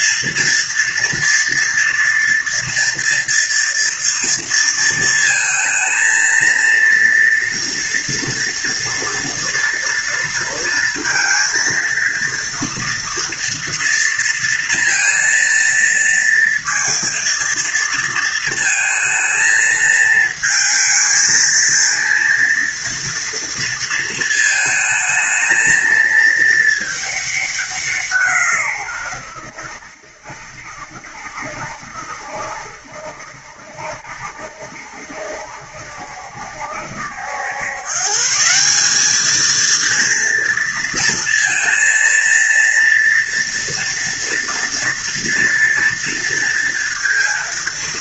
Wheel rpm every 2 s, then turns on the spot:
230, 230, 230, 230, 230, 230, 230, 230, 230, 230, 220, 230, 220, 220, 140, 70, 70, 70, 70, 160, 230, 230, 230, 230.
none